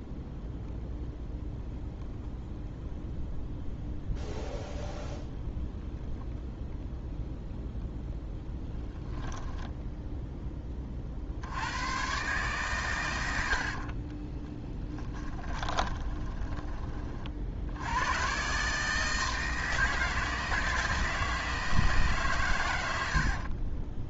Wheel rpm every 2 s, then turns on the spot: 0, 0, 0, 0, 10, 30, 120, 10, 20, 150, 160, 100.
14-16